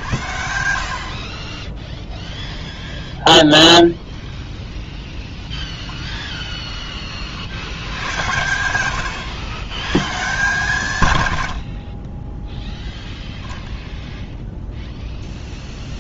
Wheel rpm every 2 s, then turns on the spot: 60, 0, 0, 30, 100, 120, 0, 0.
none